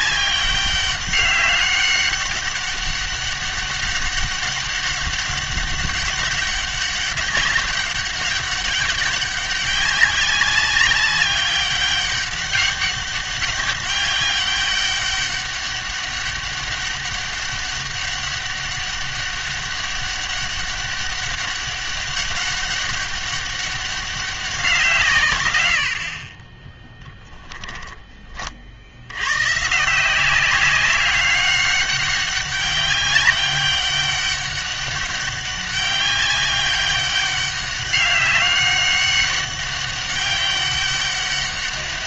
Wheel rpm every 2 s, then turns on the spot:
200, 190, 200, 200, 200, 200, 200, 200, 200, 200, 200, 200, 180, 20, 50, 190, 190, 200, 200, 200, 200.
26-28